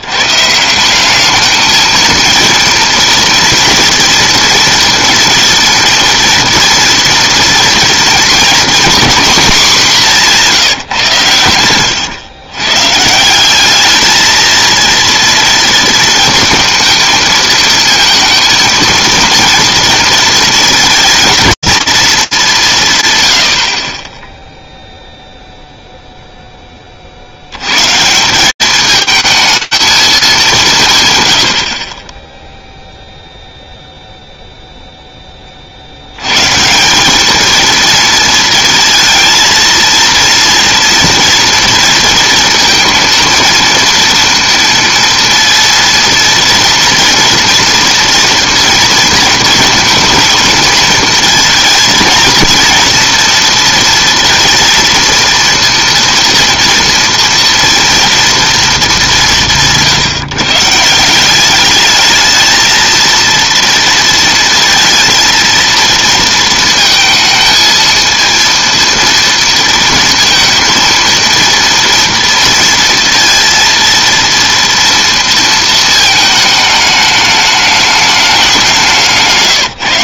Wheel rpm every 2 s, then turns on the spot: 160, 230, 230, 230, 230, 180, 120, 230, 230, 230, 230, 220, 10, 10, 190, 200, 0, 10, 200, 230, 230, 230, 230, 230, 230, 220, 240, 230, 230, 200, 170, 230, 230, 220, 230, 230, 230, 230, 210, 160.
78-80